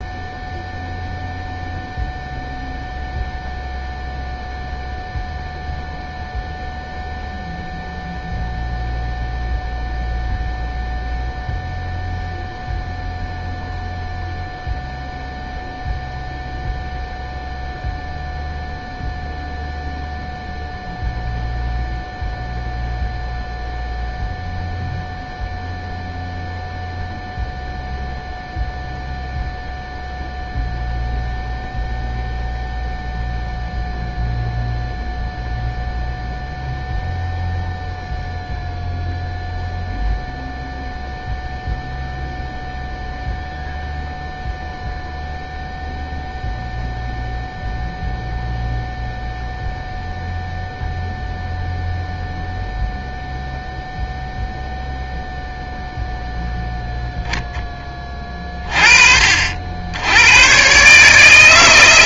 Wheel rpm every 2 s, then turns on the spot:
0, 0, 0, 0, 0, 0, 0, 0, 0, 0, 0, 0, 0, 0, 0, 0, 0, 0, 0, 0, 0, 0, 0, 0, 0, 0, 0, 0, 0, 30, 110.
none